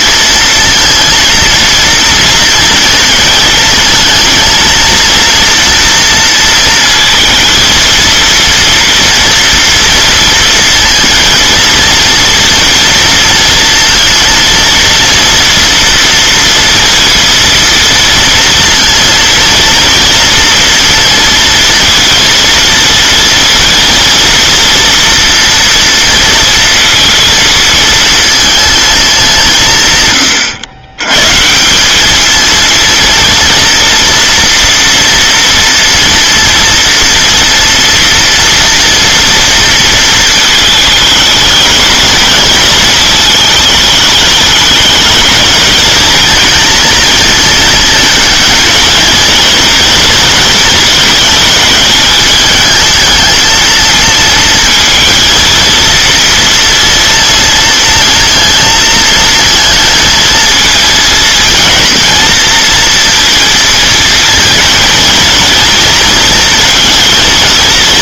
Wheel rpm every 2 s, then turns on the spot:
230, 230, 230, 230, 230, 230, 230, 230, 230, 230, 230, 230, 230, 230, 220, 100, 230, 240, 240, 240, 220, 220, 210, 230, 220, 230, 220, 230, 230, 230, 230, 230, 230, 230.
none